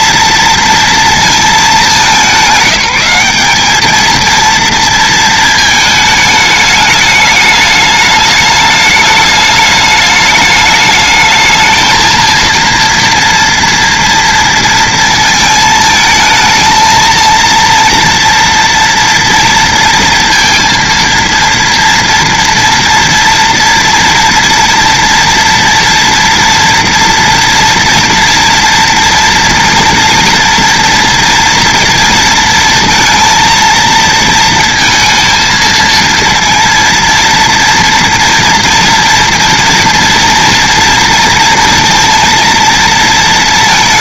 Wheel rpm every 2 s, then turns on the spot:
230, 190, 230, 210, 210, 210, 230, 230, 230, 230, 230, 240, 230, 230, 230, 230, 230, 230, 230, 230, 230, 230.
none